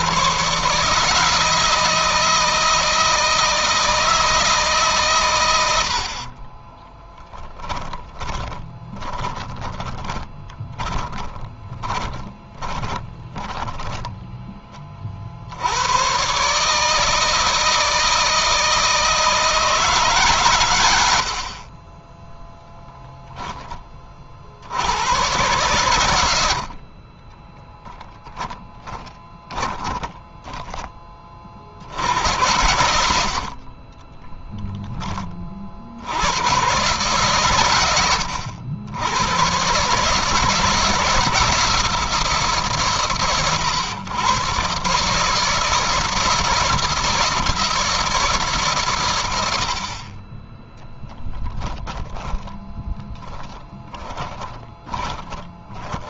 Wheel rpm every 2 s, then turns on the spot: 150, 160, 130, 10, 20, 20, 20, 30, 150, 160, 110, 0, 90, 40, 10, 20, 90, 10, 120, 100, 160, 150, 130, 160, 130, 10, 10, 20.
6-14 26-30 50-56